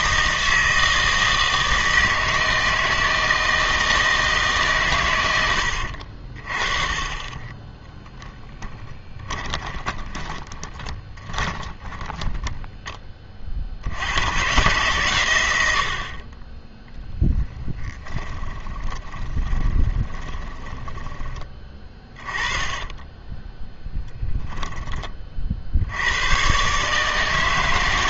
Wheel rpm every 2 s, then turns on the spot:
160, 160, 150, 40, 10, 20, 10, 130, 20, 20, 20, 20, 10, 130.
8-12 18-24